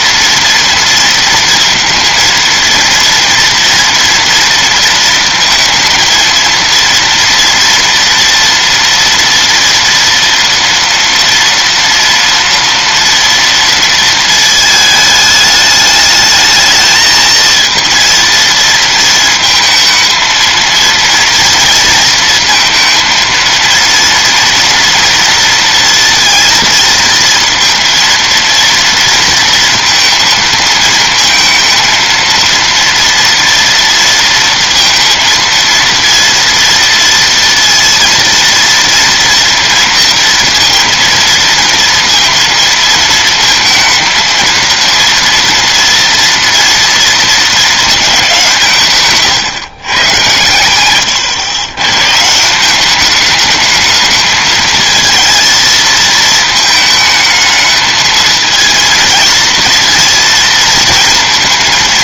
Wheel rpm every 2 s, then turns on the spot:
230, 230, 230, 230, 230, 230, 230, 220, 220, 230, 230, 230, 230, 230, 230, 230, 230, 230, 230, 230, 230, 230, 230, 230, 170, 120, 170, 220, 220, 230, 230.
none